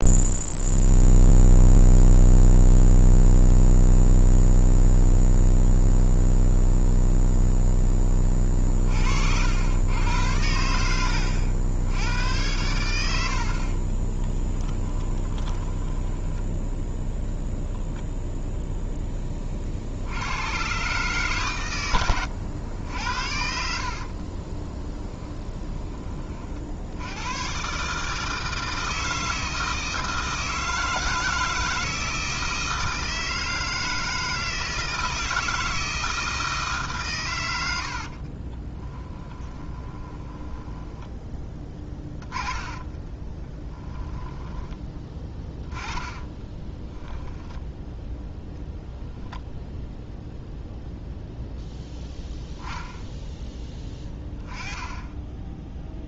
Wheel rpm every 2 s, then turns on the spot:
0, 0, 0, 0, 40, 80, 100, 10, 10, 10, 130, 80, 30, 70, 160, 160, 160, 160, 150, 30, 10, 20, 10, 20, 0, 0, 0, 10.
14-16 24-26 38-44 46-48